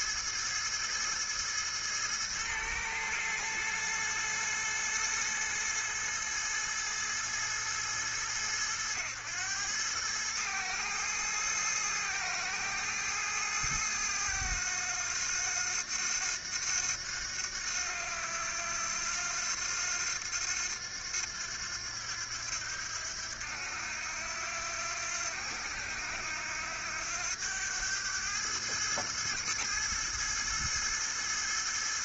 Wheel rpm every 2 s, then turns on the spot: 110, 110, 110, 110, 100, 110, 110, 100, 90, 90, 90, 90, 90, 90, 110, 110.
none